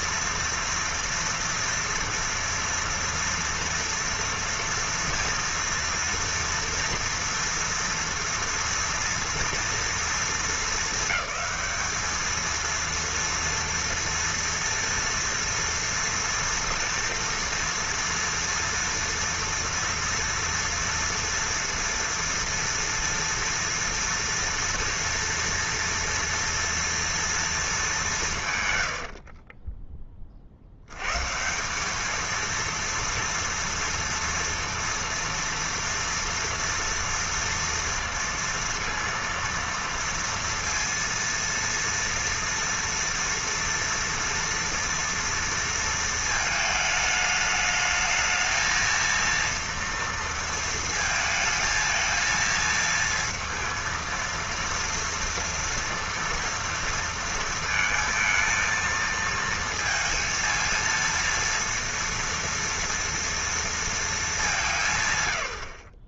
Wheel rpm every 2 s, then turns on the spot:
240, 230, 230, 230, 230, 220, 220, 230, 240, 230, 230, 230, 230, 230, 140, 60, 220, 230, 230, 230, 230, 230, 230, 220, 220, 230, 230, 230, 230, 230, 230, 230, 200.
none